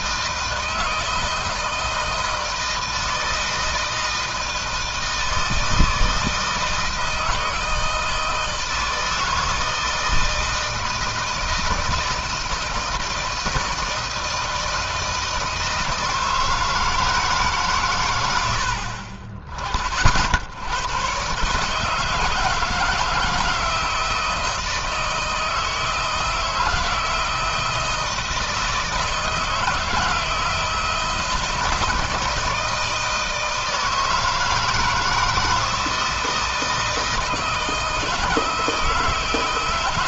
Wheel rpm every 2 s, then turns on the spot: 160, 160, 160, 160, 160, 160, 170, 160, 160, 80, 90, 160, 160, 160, 160, 160, 160, 160, 160, 160.
none